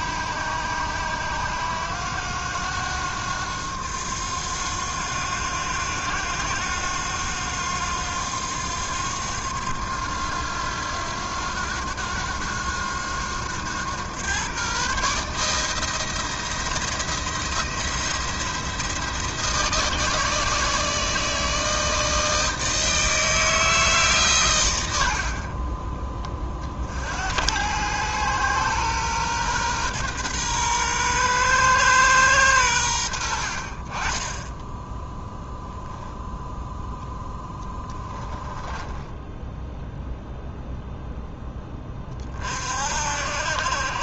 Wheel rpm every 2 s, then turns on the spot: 90, 90, 90, 90, 90, 90, 90, 130, 170, 170, 160, 160, 110, 50, 120, 120, 100, 10, 0, 10, 0, 60.
38-40